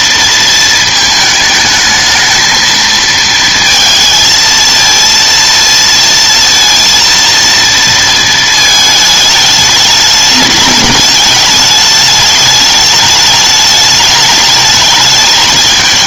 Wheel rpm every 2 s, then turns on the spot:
220, 220, 230, 230, 220, 210, 210, 210.
none